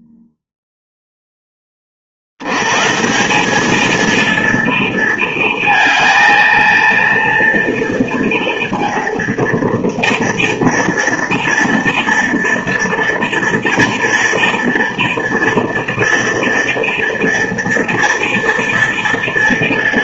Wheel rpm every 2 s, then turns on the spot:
0, 120, 230, 230, 230, 240, 230, 230, 230, 230.
none